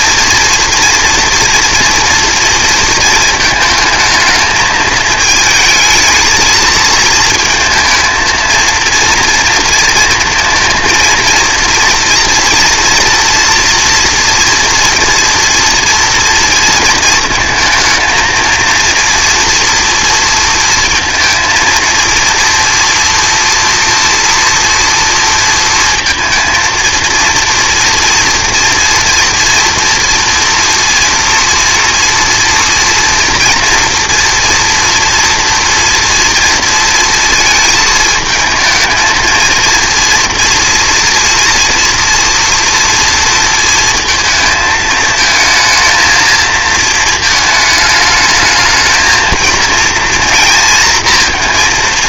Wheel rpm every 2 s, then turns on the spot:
230, 230, 220, 230, 230, 230, 230, 240, 230, 230, 230, 230, 230, 230, 230, 230, 230, 230, 230, 220, 230, 230, 230, 220, 220, 230.
none